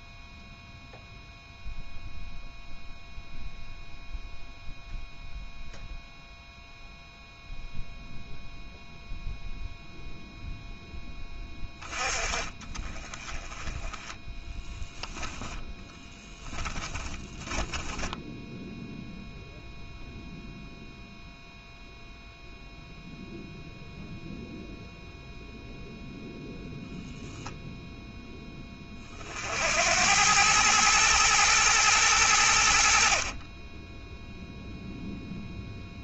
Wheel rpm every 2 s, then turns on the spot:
0, 0, 0, 0, 0, 10, 20, 10, 20, 0, 0, 0, 0, 0, 20, 110, 50, 0.
16-18